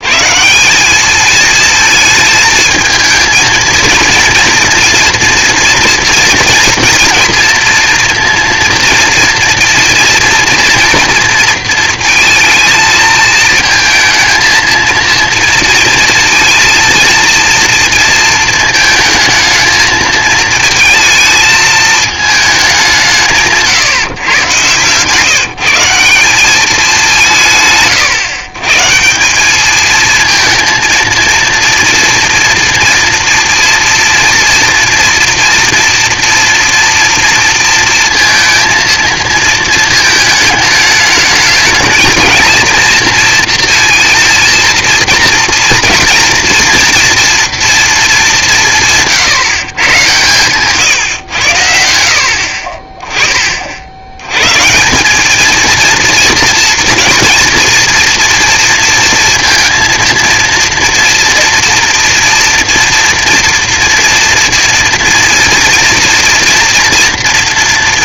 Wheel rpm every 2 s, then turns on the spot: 180, 220, 230, 230, 230, 230, 220, 230, 230, 220, 220, 200, 120, 210, 140, 230, 240, 230, 230, 230, 220, 230, 230, 240, 180, 140, 40, 170, 220, 230, 230, 230, 230, 240.
24-26